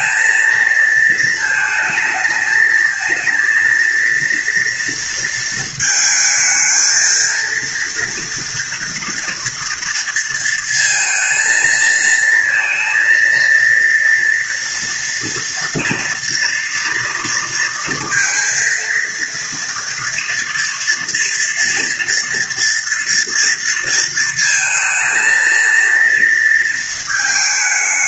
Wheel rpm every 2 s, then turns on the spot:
230, 220, 230, 220, 230, 230, 230, 230, 230, 230, 230, 230, 230, 230.
none